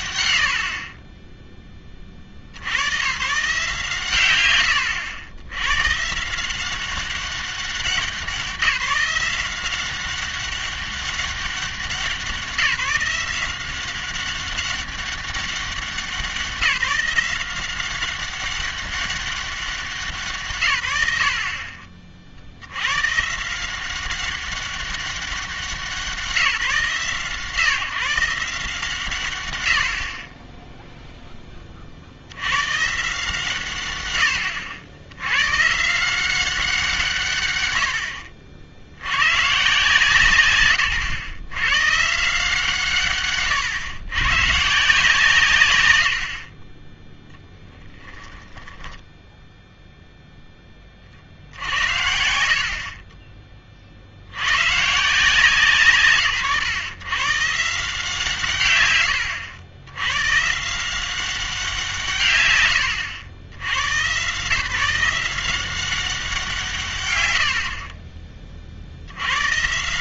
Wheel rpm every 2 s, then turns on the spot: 50, 80, 100, 180, 180, 190, 170, 200, 180, 200, 130, 80, 190, 160, 160, 10, 120, 90, 180, 60, 130, 160, 150, 20, 10, 10, 50, 120, 120, 130, 150, 110, 150, 160, 40.
48-50